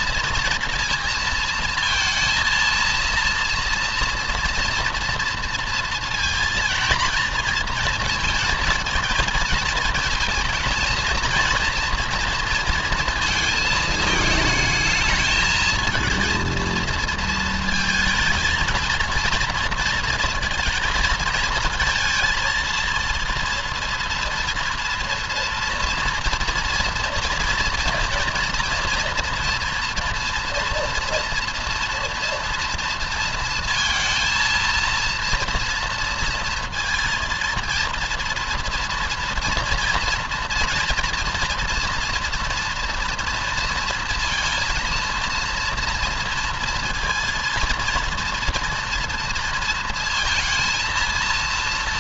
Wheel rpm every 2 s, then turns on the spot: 230, 230, 230, 230, 220, 220, 230, 220, 230, 230, 220, 230, 230, 230, 230, 240, 230, 230, 230, 230, 230, 230, 230, 230, 230, 230.
none